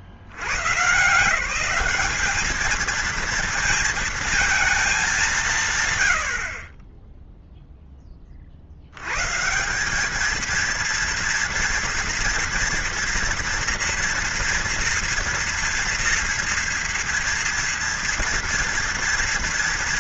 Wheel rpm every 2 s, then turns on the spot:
80, 210, 230, 50, 50, 220, 240, 230, 230, 230.
none